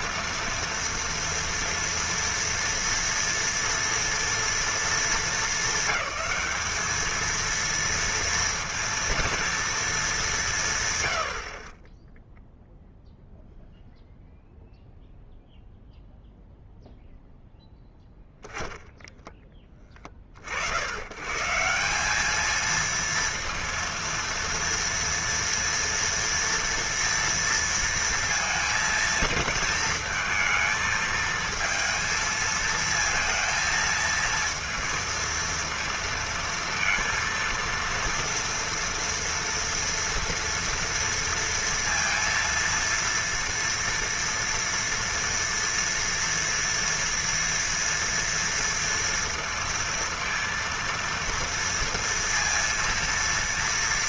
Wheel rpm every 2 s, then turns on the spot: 230, 240, 230, 200, 230, 160, 0, 0, 0, 10, 70, 220, 230, 230, 230, 220, 230, 230, 230, 230, 230, 230, 230, 240, 230, 230, 230.
none